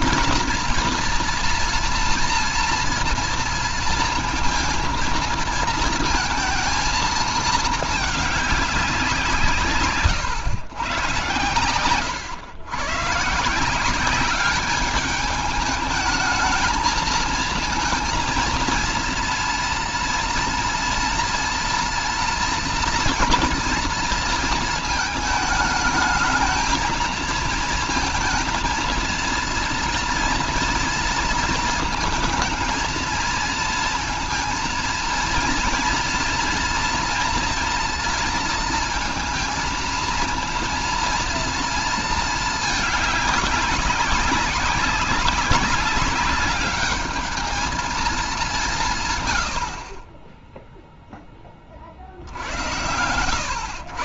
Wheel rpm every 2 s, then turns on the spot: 230, 230, 230, 220, 180, 110, 120, 210, 220, 230, 230, 240, 220, 220, 230, 230, 220, 230, 230, 220, 230, 210, 190, 210, 140, 0, 100.
none